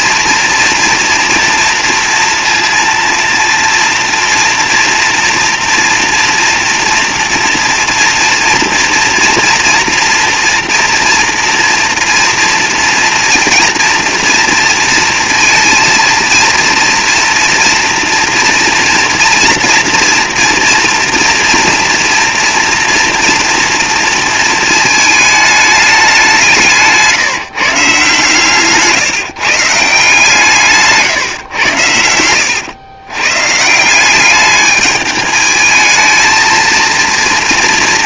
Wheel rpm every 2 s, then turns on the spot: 230, 230, 230, 230, 230, 240, 230, 230, 230, 230, 230, 230, 220, 170, 150, 150, 100, 210, 230.
none